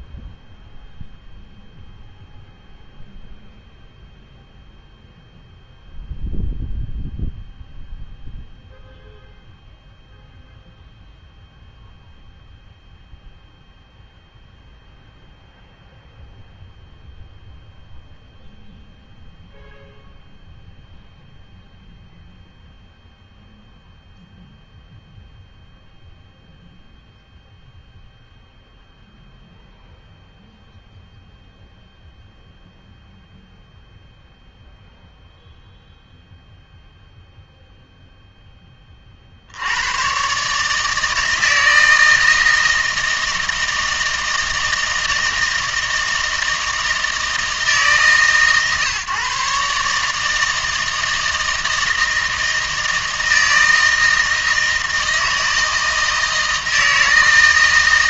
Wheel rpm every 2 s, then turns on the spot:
0, 0, 0, 0, 0, 0, 0, 0, 0, 0, 0, 0, 0, 0, 0, 0, 0, 0, 0, 20, 150, 160, 160, 160, 130, 160, 160, 160, 160.
none